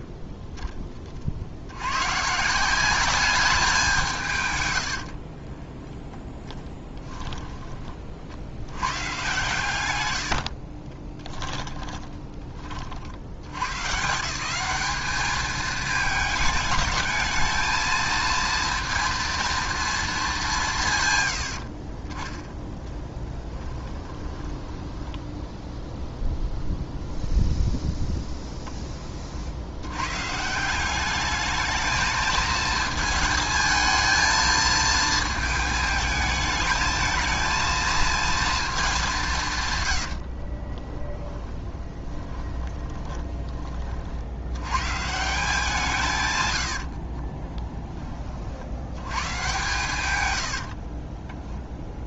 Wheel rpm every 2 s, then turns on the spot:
10, 180, 120, 10, 100, 50, 40, 180, 210, 230, 160, 10, 10, 0, 10, 170, 220, 220, 220, 220, 30, 20, 120, 70, 70, 70.
4-8 10-12 22-26 40-44 50-52